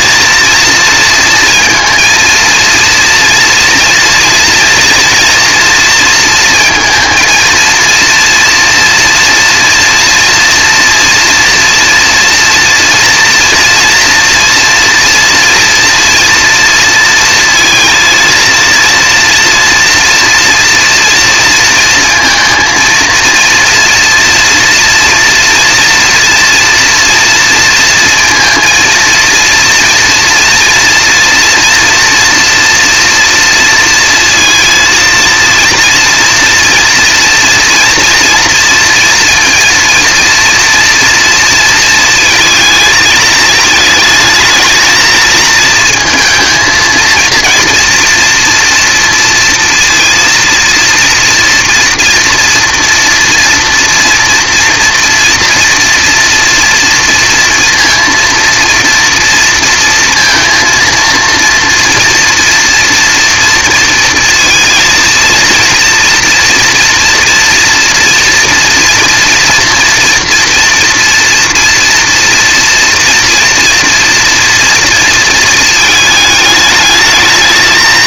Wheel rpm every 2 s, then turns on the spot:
230, 230, 240, 230, 230, 230, 230, 230, 230, 230, 240, 230, 230, 230, 230, 230, 230, 230, 230, 230, 230, 220, 220, 230, 230, 230, 240, 230, 230, 230, 230, 230, 230, 230, 230, 240, 230, 230, 210.
none